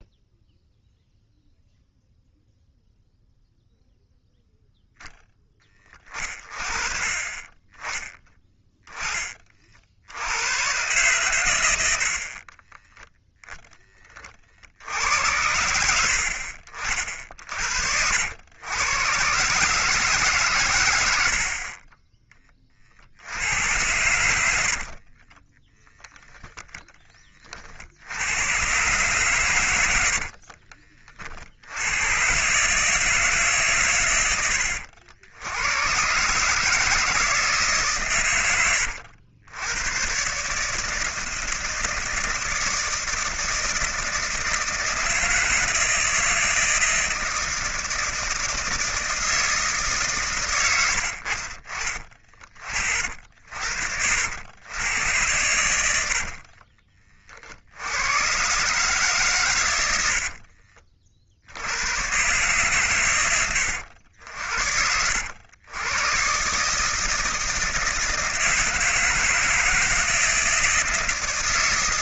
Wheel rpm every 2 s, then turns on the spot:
0, 0, 0, 30, 10, 120, 20, 70, 50, 110, 100, 60, 40, 10, 120, 50, 150, 80, 160, 90, 160, 160, 160, 160, 160, 90, 50, 100, 30, 130, 50, 130, 70, 150, 160, 160.
12-14 24-26